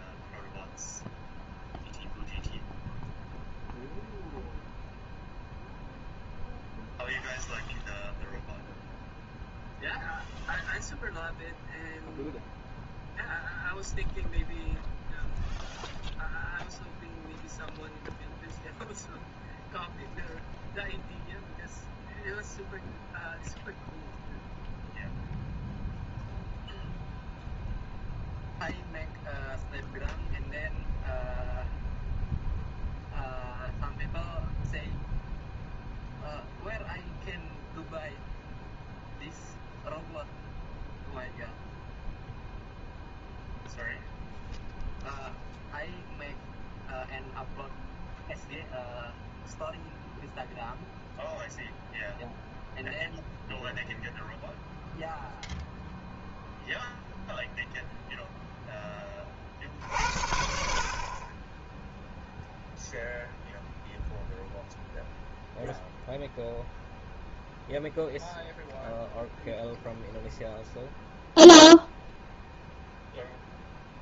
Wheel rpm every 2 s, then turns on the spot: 0, 0, 0, 0, 0, 0, 0, 0, 0, 0, 0, 0, 0, 0, 0, 0, 0, 0, 0, 0, 0, 0, 0, 0, 0, 0, 0, 0, 0, 10, 60, 0, 0, 0, 0, 0, 0.
none